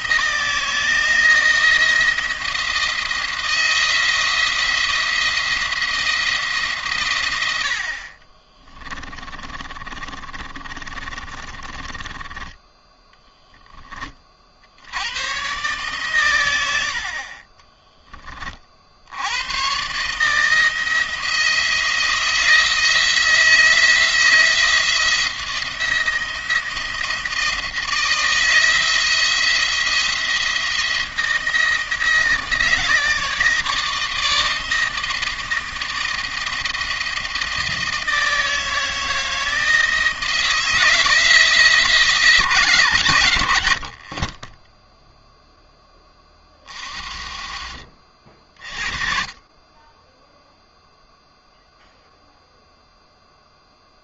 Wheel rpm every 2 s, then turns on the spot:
160, 170, 170, 140, 20, 30, 10, 80, 80, 50, 160, 160, 170, 170, 170, 170, 160, 160, 160, 160, 160, 130, 10, 40, 30, 0, 0.
8-12